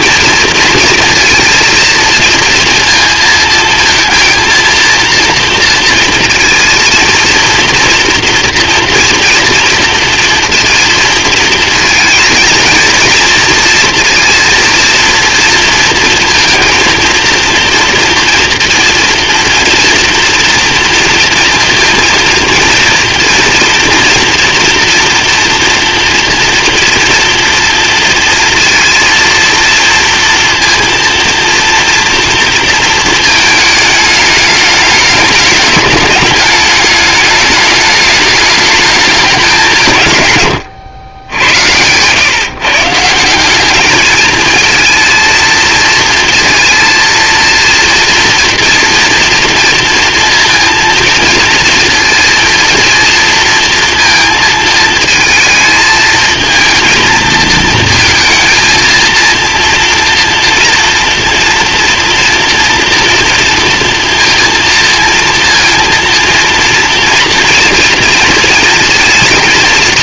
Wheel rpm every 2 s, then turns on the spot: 230, 230, 230, 230, 240, 230, 230, 230, 230, 230, 230, 230, 230, 230, 230, 230, 230, 210, 210, 210, 110, 150, 220, 230, 230, 230, 230, 220, 220, 230, 240, 230, 230, 230, 230.
40-42